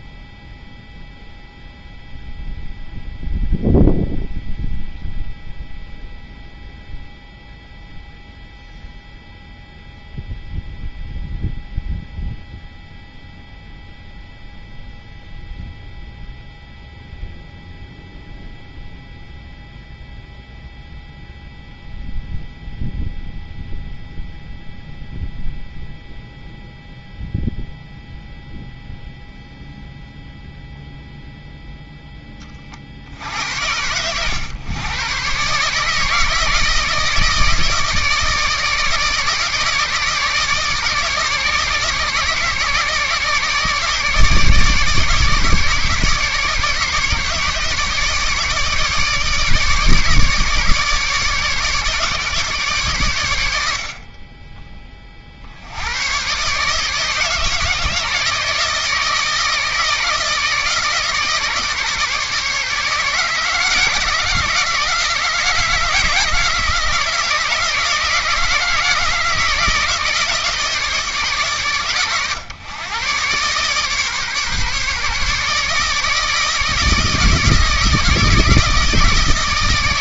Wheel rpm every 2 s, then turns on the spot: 0, 0, 0, 0, 0, 0, 0, 0, 0, 0, 0, 0, 0, 0, 0, 0, 70, 130, 160, 150, 150, 150, 150, 150, 150, 150, 110, 50, 160, 160, 150, 150, 160, 160, 160, 140, 130, 150, 160, 160.
none